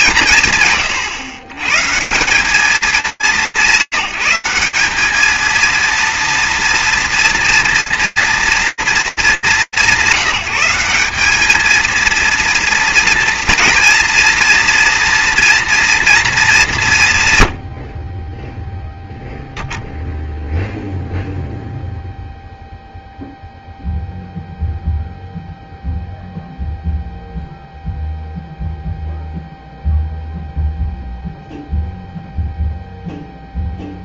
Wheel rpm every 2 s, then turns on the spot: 120, 160, 230, 230, 180, 230, 240, 230, 90, 0, 0, 0, 0, 0, 0, 0, 0.
none